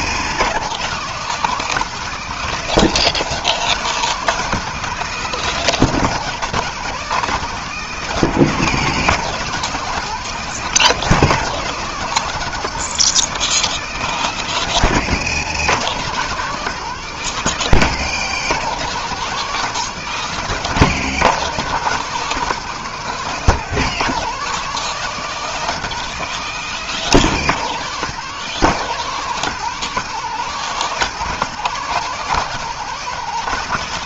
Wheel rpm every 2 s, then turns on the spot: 170, 190, 190, 190, 190, 190, 190, 170, 180, 180, 180, 190, 190, 190, 180, 180, 190.
none